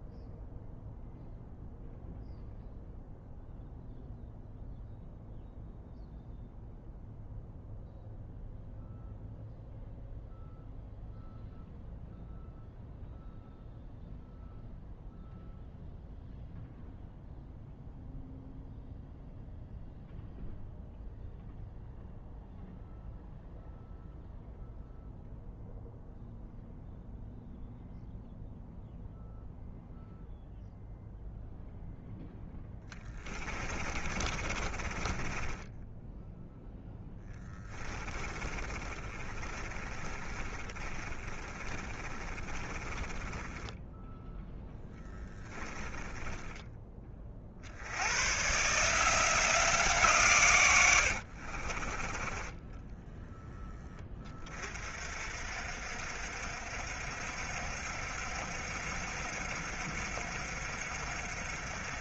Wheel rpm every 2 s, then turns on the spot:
0, 0, 0, 0, 0, 0, 0, 0, 0, 0, 0, 0, 0, 0, 0, 0, 10, 20, 0, 20, 20, 20, 0, 20, 150, 110, 10, 40, 60, 60, 60.
32-36 38-44 50-54